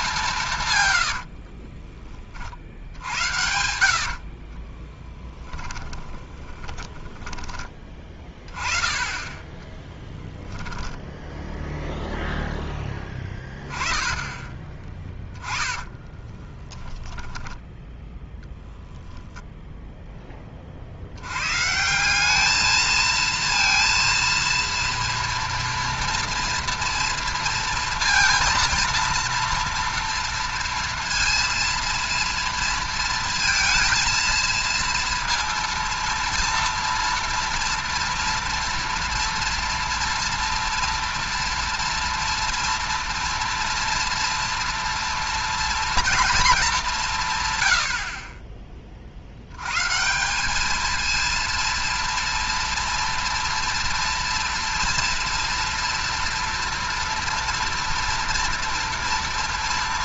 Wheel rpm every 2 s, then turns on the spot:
150, 50, 40, 30, 20, 10, 10, 20, 10, 0, 30, 220, 230, 240, 230, 230, 230, 230, 230, 230, 230, 230, 230, 220, 30, 210, 230, 230, 230, 230.
0-2 4-8 10-12 16-18